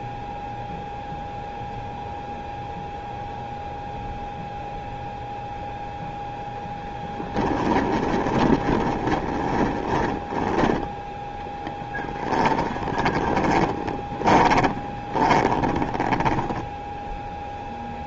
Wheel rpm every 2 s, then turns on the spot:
0, 0, 0, 10, 30, 10, 20, 20, 10.
8-10 12-18